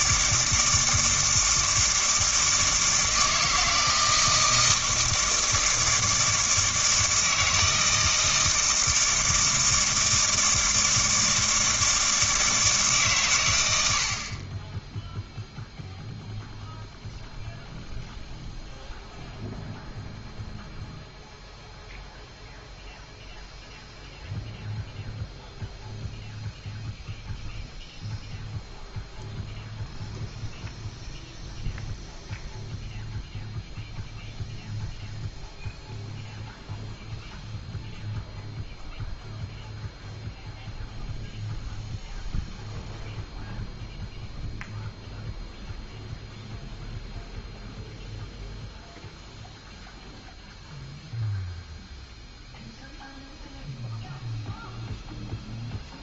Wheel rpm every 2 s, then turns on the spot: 160, 160, 160, 160, 160, 160, 150, 10, 0, 0, 0, 0, 0, 0, 0, 0, 0, 0, 0, 0, 0, 0, 0, 0, 0, 0, 0, 0.
none